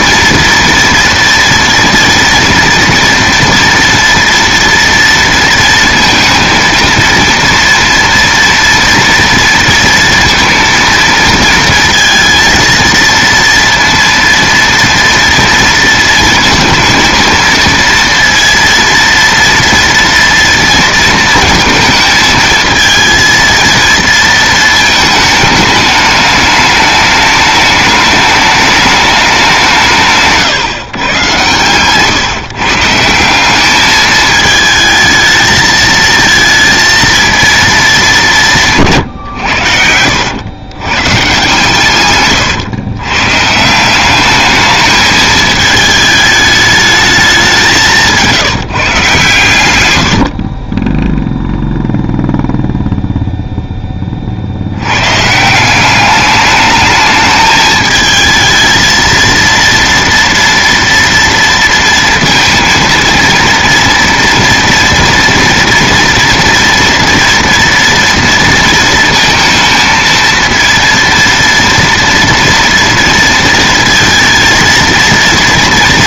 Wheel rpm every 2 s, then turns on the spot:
240, 230, 230, 230, 230, 230, 230, 230, 230, 230, 230, 230, 220, 210, 210, 140, 170, 220, 230, 140, 140, 120, 220, 210, 140, 10, 0, 130, 210, 220, 230, 230, 230, 230, 230, 230, 230, 230.
none